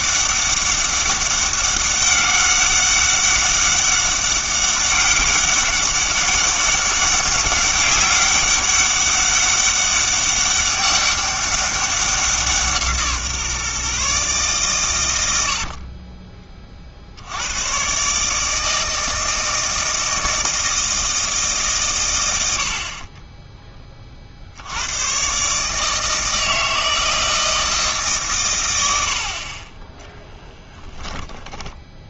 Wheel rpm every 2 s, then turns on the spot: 200, 190, 200, 200, 200, 200, 160, 120, 50, 160, 160, 60, 90, 160, 90, 10.
30-32